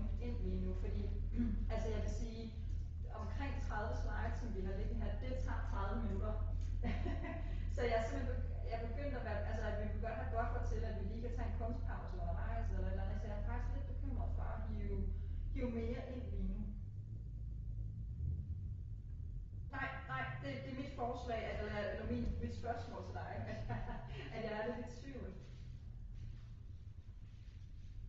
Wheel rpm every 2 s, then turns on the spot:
0, 0, 0, 0, 0, 0, 0, 0, 0, 0, 0, 0, 0, 0.
none